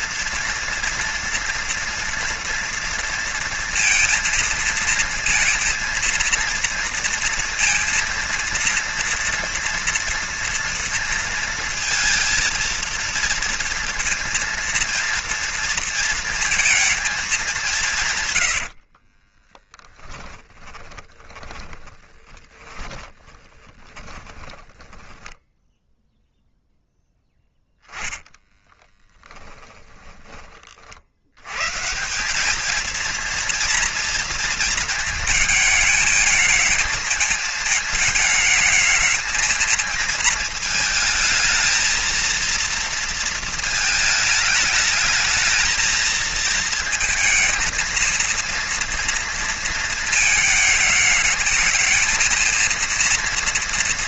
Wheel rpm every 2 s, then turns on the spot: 230, 230, 230, 230, 230, 230, 230, 230, 230, 60, 20, 10, 10, 0, 10, 40, 220, 220, 220, 220, 230, 230, 210, 220, 230, 220, 230.
18-26 28-30